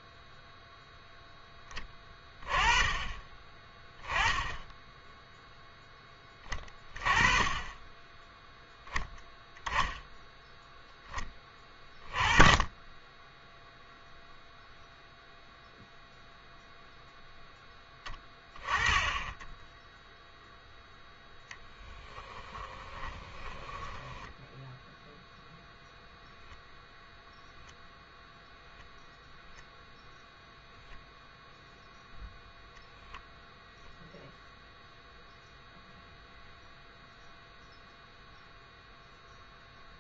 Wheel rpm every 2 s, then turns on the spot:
0, 20, 10, 20, 0, 0, 20, 0, 0, 20, 0, 10, 0, 0, 0, 0, 0, 0, 0, 0.
22-24